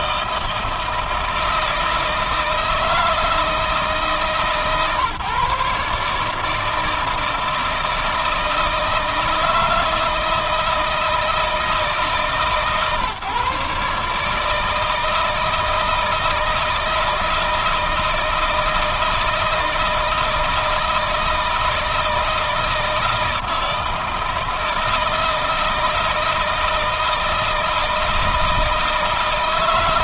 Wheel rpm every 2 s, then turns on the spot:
160, 160, 140, 160, 160, 160, 150, 160, 160, 160, 160, 160, 160, 160, 160.
none